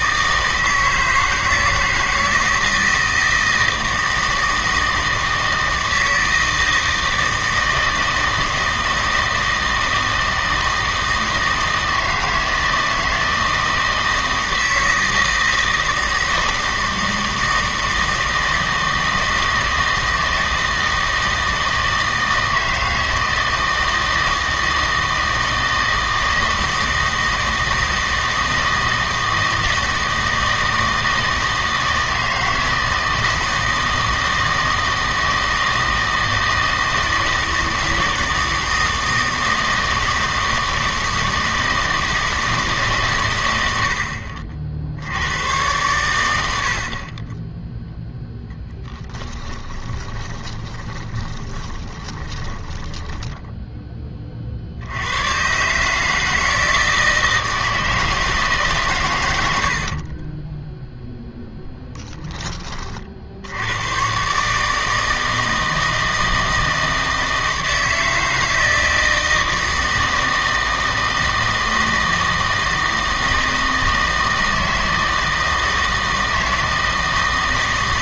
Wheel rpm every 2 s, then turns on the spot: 160, 160, 160, 160, 160, 160, 160, 160, 160, 160, 160, 160, 160, 160, 160, 160, 160, 160, 160, 160, 160, 150, 50, 60, 10, 20, 20, 60, 160, 140, 0, 30, 150, 160, 160, 160, 160, 160, 160.
48-54